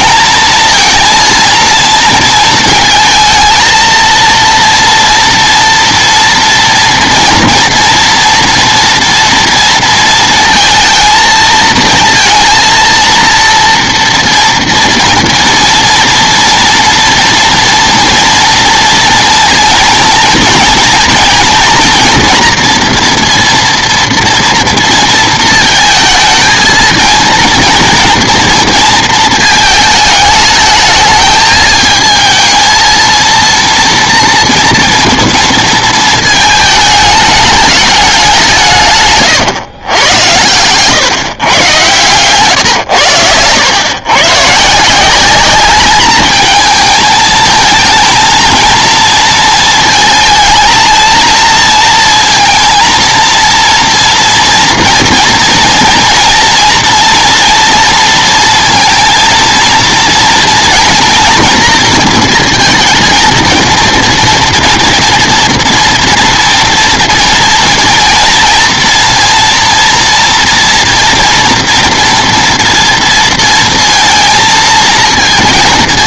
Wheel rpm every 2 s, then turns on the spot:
230, 220, 230, 230, 230, 230, 230, 230, 230, 230, 230, 240, 230, 230, 230, 210, 220, 230, 220, 150, 120, 100, 160, 220, 230, 220, 230, 230, 230, 230, 240, 230, 230, 230, 230, 230, 230, 230.
none